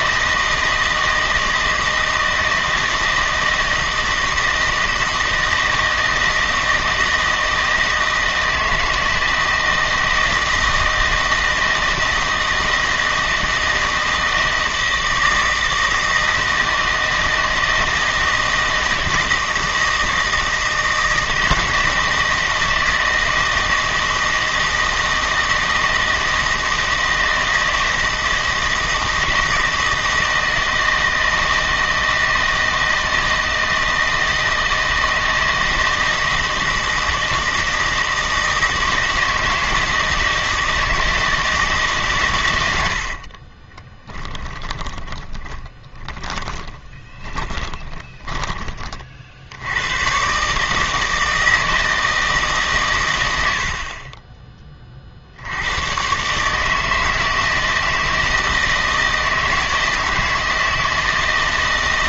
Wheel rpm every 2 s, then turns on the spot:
160, 160, 160, 160, 160, 160, 160, 160, 160, 160, 160, 160, 160, 160, 160, 160, 160, 160, 160, 160, 160, 80, 20, 30, 30, 150, 130, 30, 160, 160, 160.
44-48